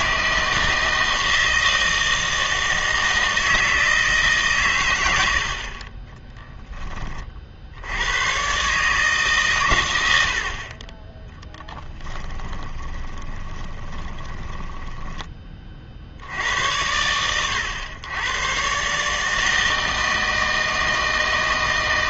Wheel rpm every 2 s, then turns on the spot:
160, 160, 130, 10, 140, 40, 20, 10, 100, 120, 160.
12-16